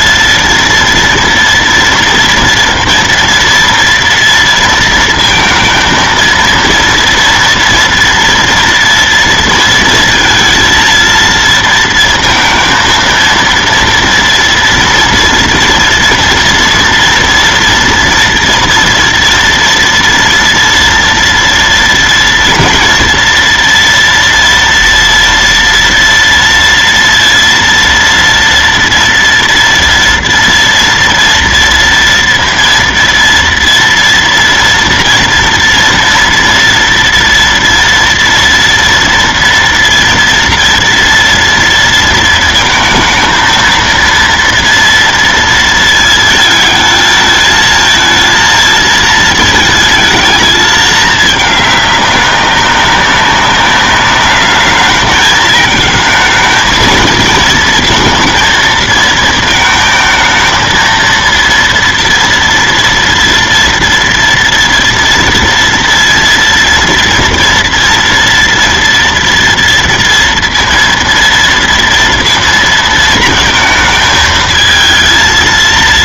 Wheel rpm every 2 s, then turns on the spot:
230, 230, 230, 230, 230, 230, 230, 240, 230, 230, 240, 230, 230, 230, 230, 230, 230, 230, 230, 230, 230, 220, 230, 220, 230, 220, 200, 210, 220, 230, 230, 230, 230, 230, 230, 230, 230, 220.
none